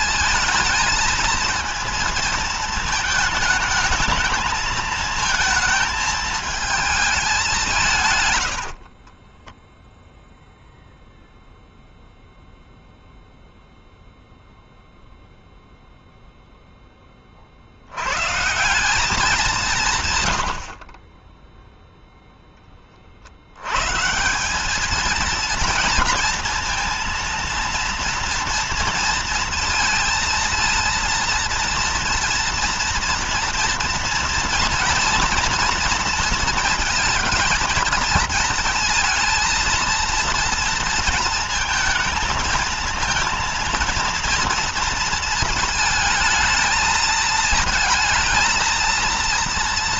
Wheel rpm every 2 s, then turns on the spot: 230, 220, 220, 190, 10, 0, 0, 0, 10, 180, 50, 10, 190, 230, 230, 230, 230, 230, 230, 220, 230, 220, 230, 220, 230.
8-10